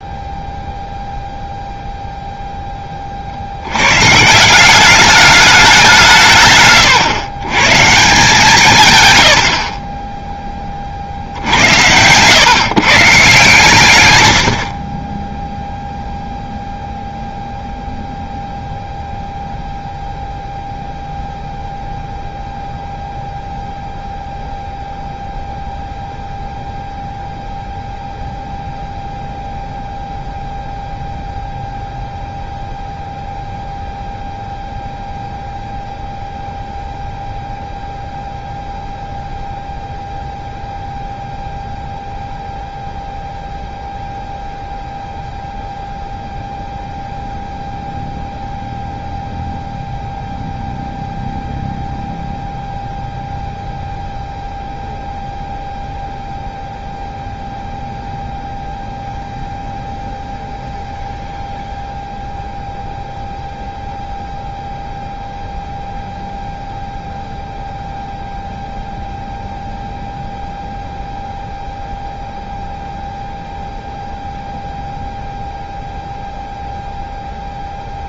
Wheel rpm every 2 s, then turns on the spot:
0, 10, 180, 130, 150, 10, 120, 70, 0, 0, 0, 0, 0, 0, 0, 0, 0, 0, 0, 0, 0, 0, 0, 0, 0, 0, 0, 0, 0, 0, 0, 0, 0, 0, 0, 0, 0, 0, 0.
none